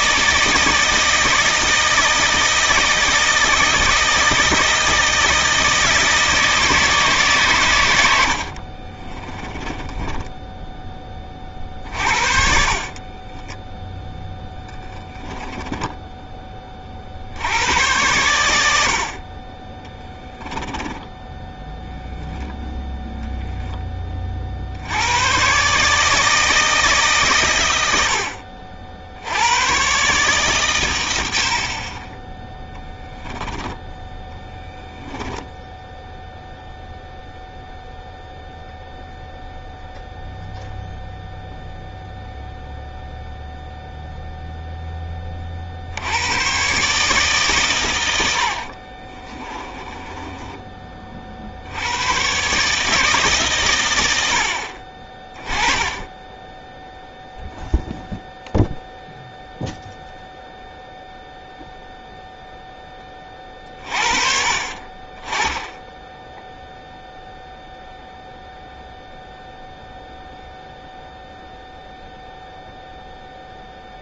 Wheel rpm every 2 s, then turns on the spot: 160, 160, 160, 160, 40, 20, 40, 20, 30, 70, 10, 0, 70, 150, 70, 110, 10, 10, 0, 0, 0, 0, 10, 140, 50, 30, 150, 40, 0, 0, 0, 10, 40, 0, 0, 0, 0.
8-10 12-16 20-22 34-36 48-50